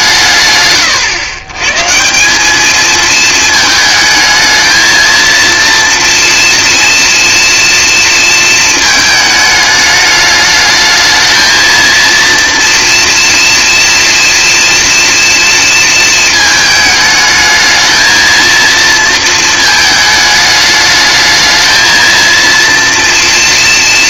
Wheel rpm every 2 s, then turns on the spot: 110, 220, 230, 230, 210, 220, 230, 230, 220, 220, 220, 230.
none